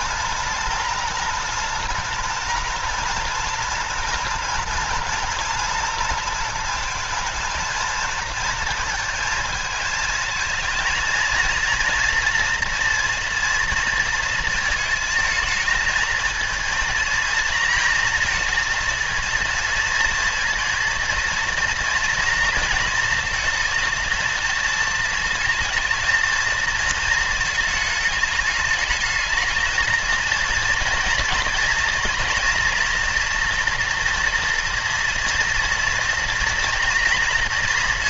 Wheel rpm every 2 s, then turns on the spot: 230, 240, 240, 220, 230, 230, 230, 220, 230, 230, 230, 230, 230, 230, 210, 230, 240, 230, 230.
none